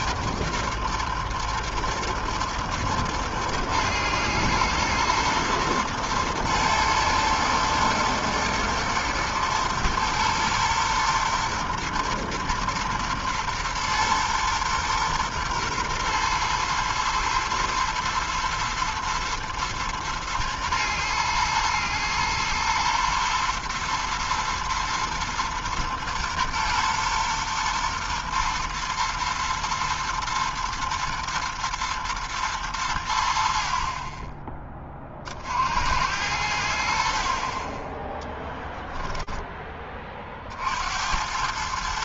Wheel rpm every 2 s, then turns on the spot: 120, 120, 120, 110, 120, 120, 120, 120, 120, 120, 120, 110, 110, 110, 120, 120, 110, 20, 90, 10, 40.
none